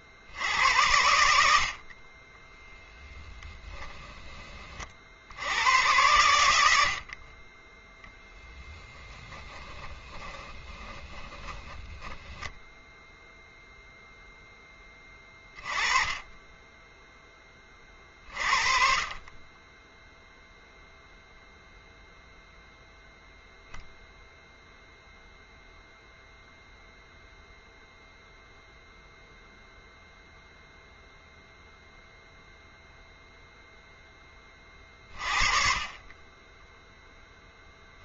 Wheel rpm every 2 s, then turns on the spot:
90, 10, 40, 80, 20, 20, 0, 10, 10, 40, 0, 0, 0, 0, 0, 0, 0, 30, 10.
2-4 8-12